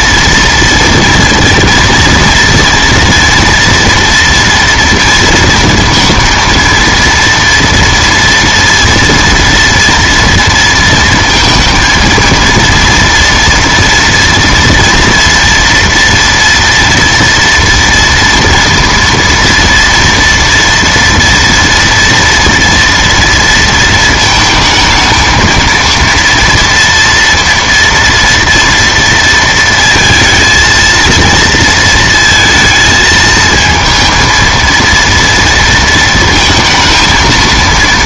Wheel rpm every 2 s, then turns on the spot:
230, 230, 230, 230, 230, 230, 230, 230, 230, 230, 230, 230, 220, 230, 230, 230, 230, 230, 230.
none